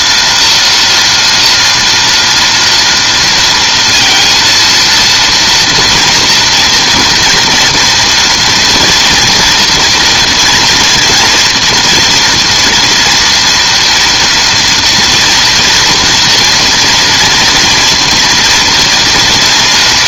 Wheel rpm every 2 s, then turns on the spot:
230, 230, 230, 230, 240, 230, 230, 230, 240, 230.
none